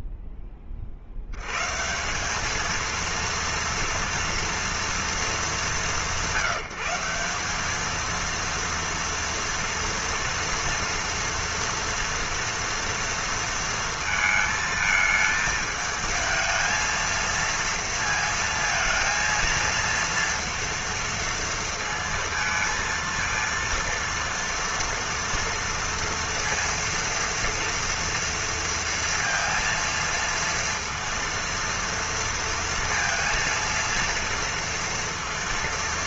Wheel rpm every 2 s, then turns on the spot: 10, 180, 230, 170, 230, 230, 230, 220, 220, 230, 230, 230, 230, 230, 230, 230, 230, 230.
none